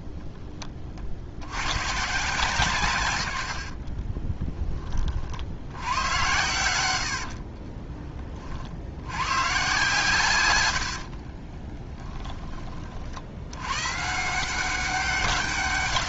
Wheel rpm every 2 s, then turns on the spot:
40, 140, 10, 90, 60, 100, 40, 190.
10-12